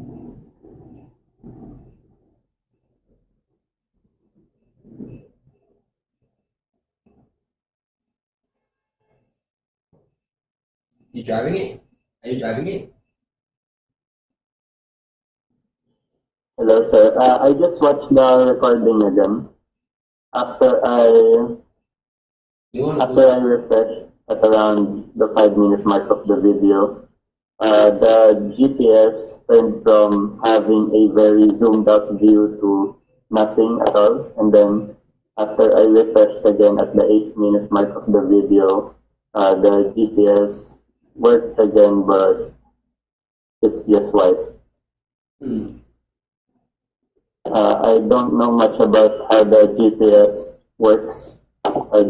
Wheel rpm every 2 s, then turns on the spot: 0, 0, 0, 0, 0, 0, 0, 0, 0, 0, 0, 0, 0, 0, 0, 0, 0, 0, 0, 0, 0, 0, 0, 0, 0, 0.
none